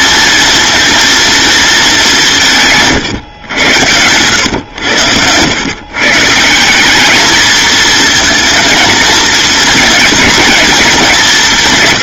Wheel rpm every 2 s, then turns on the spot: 230, 150, 90, 180, 230, 210.
none